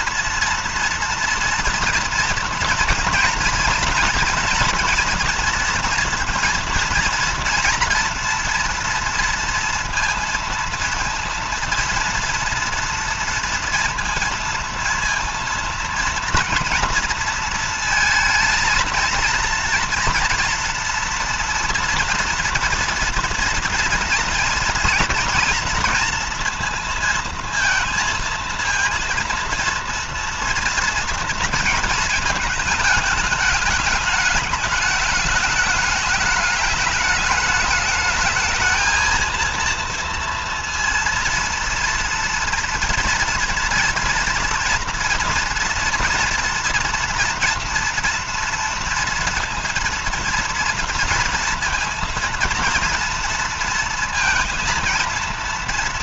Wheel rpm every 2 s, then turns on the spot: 230, 230, 240, 230, 240, 230, 230, 230, 230, 230, 240, 230, 230, 230, 230, 230, 220, 210, 220, 220, 230, 230, 240, 230, 230, 230, 230, 230.
none